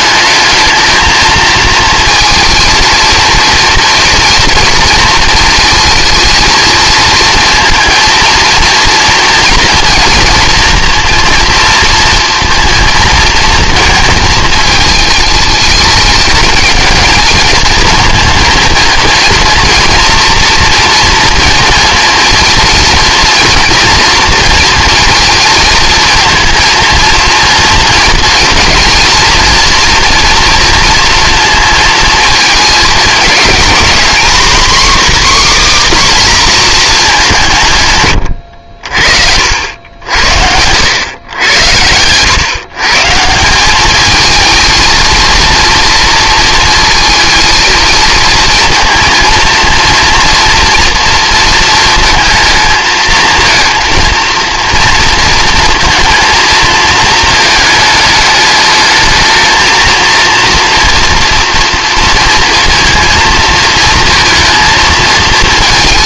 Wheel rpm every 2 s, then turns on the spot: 220, 220, 230, 230, 230, 230, 230, 220, 220, 230, 230, 230, 230, 230, 230, 240, 220, 270, 240, 60, 90, 140, 230, 230, 220, 230, 230, 230, 230, 210, 230, 230, 220.
none